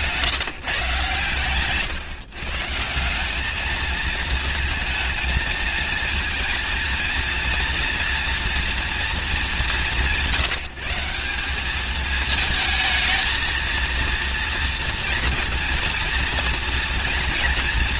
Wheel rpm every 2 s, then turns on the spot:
140, 160, 230, 230, 240, 160, 220, 230, 230.
none